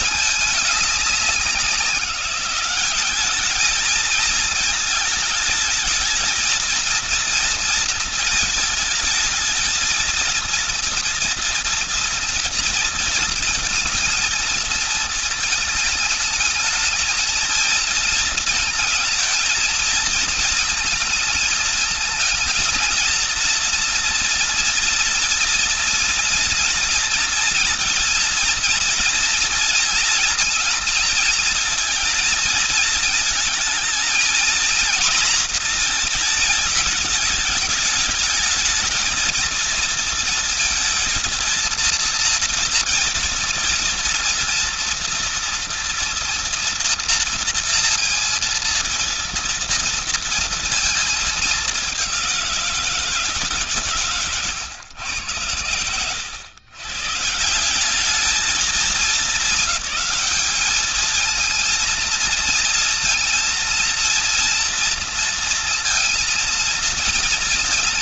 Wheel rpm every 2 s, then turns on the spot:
210, 190, 220, 220, 220, 230, 230, 220, 220, 220, 230, 230, 230, 230, 230, 230, 230, 230, 220, 220, 230, 230, 230, 230, 230, 230, 180, 120, 120, 220, 220, 230, 230, 230.
none